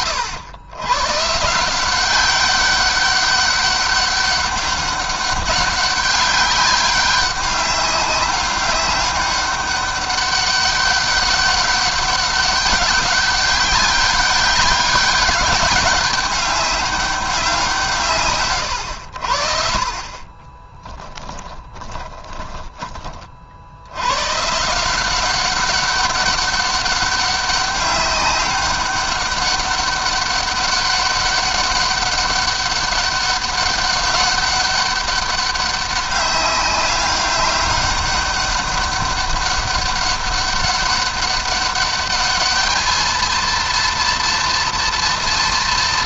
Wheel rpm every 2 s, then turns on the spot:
120, 200, 200, 200, 200, 200, 200, 200, 200, 100, 20, 10, 160, 200, 200, 200, 200, 200, 200, 200, 200, 220, 230.
20-22